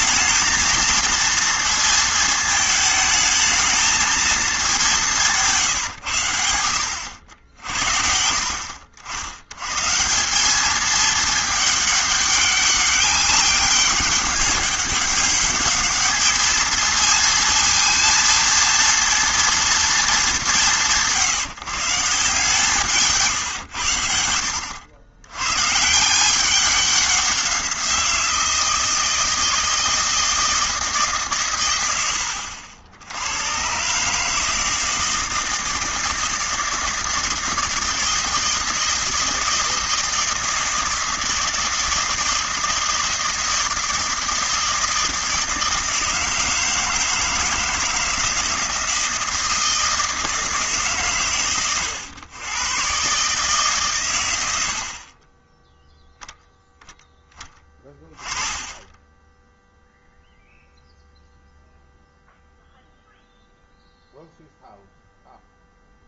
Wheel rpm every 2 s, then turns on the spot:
220, 220, 220, 90, 60, 200, 200, 200, 220, 230, 180, 160, 80, 190, 160, 160, 80, 160, 160, 160, 160, 160, 160, 160, 160, 150, 110, 80, 0, 20, 0, 0, 0.
none